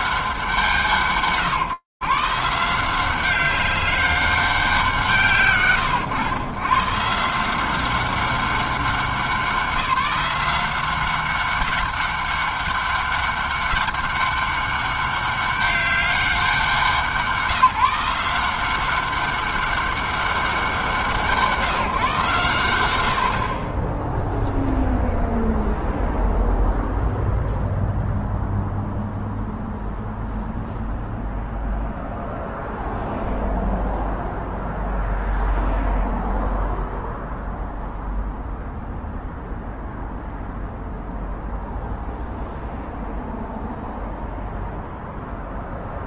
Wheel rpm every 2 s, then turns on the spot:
160, 170, 170, 120, 190, 190, 200, 200, 180, 180, 180, 120, 0, 0, 0, 0, 0, 0, 0, 0, 0, 0, 0.
none